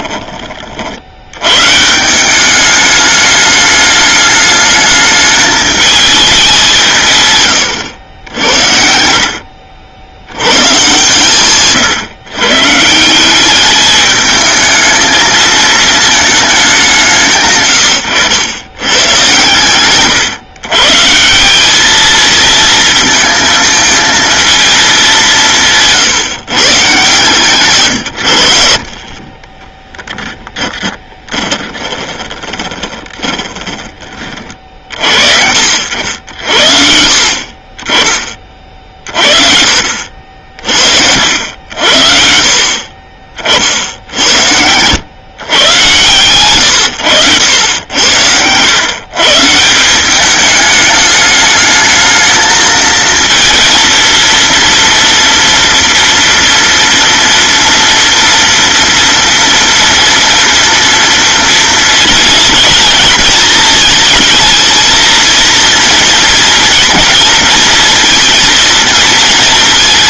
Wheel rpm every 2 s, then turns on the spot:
40, 200, 210, 190, 70, 120, 150, 220, 210, 110, 130, 220, 220, 140, 60, 10, 20, 50, 70, 30, 50, 40, 90, 100, 110, 210, 220, 230, 230, 230, 230, 220, 220, 240, 230.
30-34